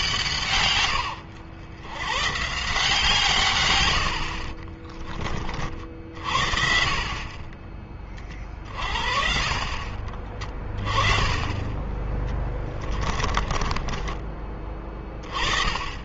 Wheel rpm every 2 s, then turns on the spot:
120, 150, 30, 50, 50, 30, 30, 20.
12-14